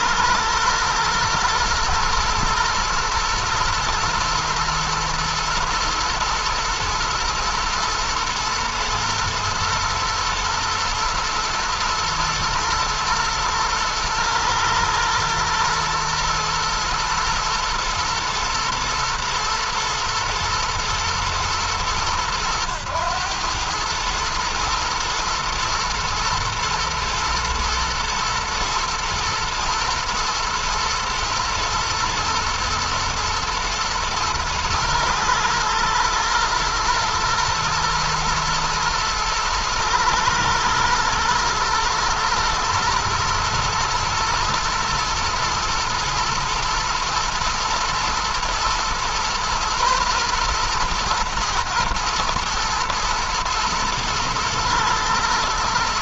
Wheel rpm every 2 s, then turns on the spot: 120, 120, 110, 110, 110, 120, 120, 120, 120, 120, 110, 100, 110, 110, 120, 120, 120, 110, 120, 110, 110, 120, 120, 110, 120, 120, 110, 110.
none